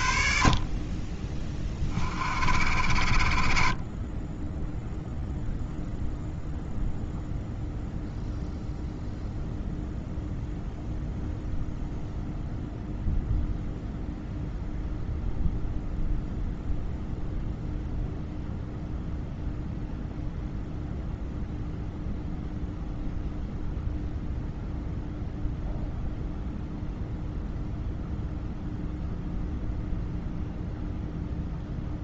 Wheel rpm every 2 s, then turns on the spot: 50, 60, 0, 0, 0, 0, 0, 0, 0, 0, 0, 0, 0, 0, 0, 0.
none